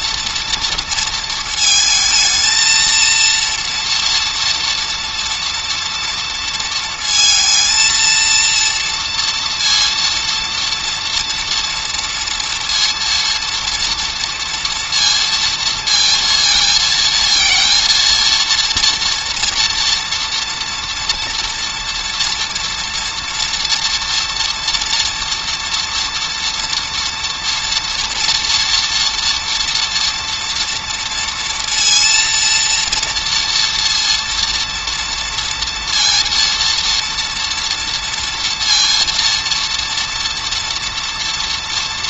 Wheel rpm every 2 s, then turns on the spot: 230, 230, 230, 230, 230, 230, 240, 230, 230, 230, 230, 230, 230, 240, 230, 230, 230, 230, 230, 230, 230.
none